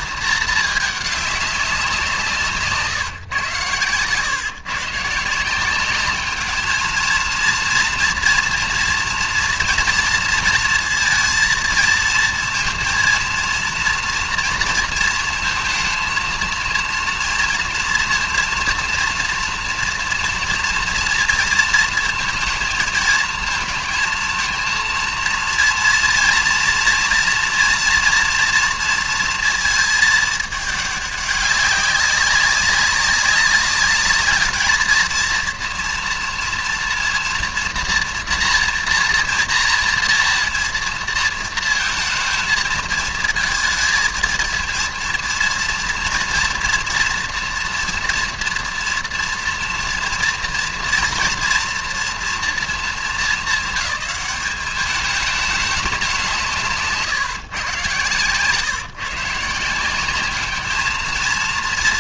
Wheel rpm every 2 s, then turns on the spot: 210, 150, 130, 220, 230, 230, 230, 230, 230, 230, 230, 220, 230, 230, 230, 210, 190, 220, 230, 240, 240, 230, 230, 240, 230, 230, 230, 210, 150, 140, 210.
none